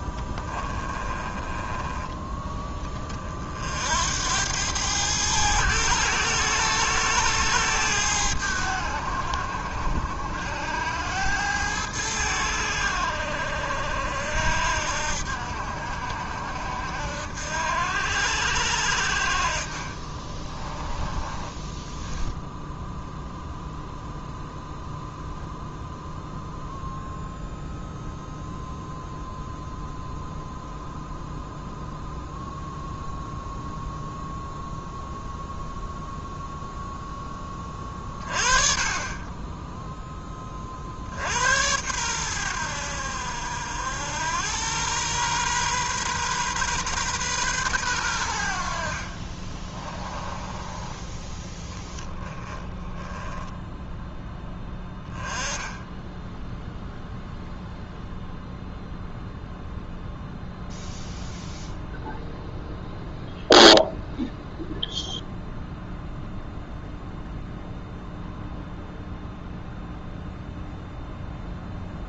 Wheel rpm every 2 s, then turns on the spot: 10, 10, 100, 110, 90, 90, 80, 70, 70, 70, 20, 0, 0, 0, 0, 0, 0, 0, 0, 30, 30, 90, 100, 130, 70, 20, 20, 10, 0, 0, 0, 0, 0, 0, 0, 0.
0-2 20-22 50-54